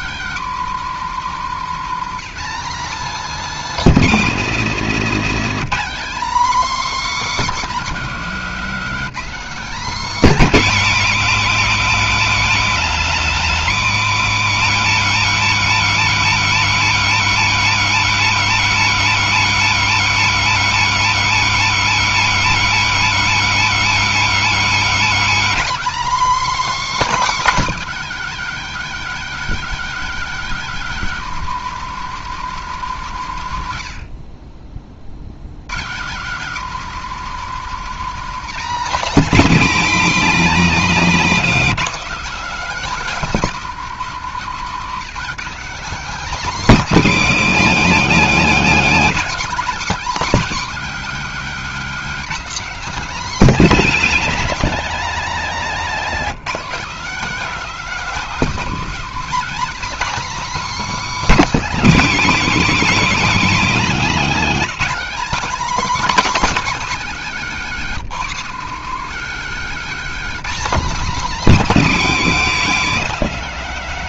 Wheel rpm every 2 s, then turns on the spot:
230, 250, 240, 260, 230, 280, 230, 240, 260, 260, 250, 250, 260, 300, 270, 260, 220, 40, 210, 260, 280, 250, 200, 270, 250, 270, 260, 230, 250, 250, 300, 260, 270, 270, 220, 270, 250.
none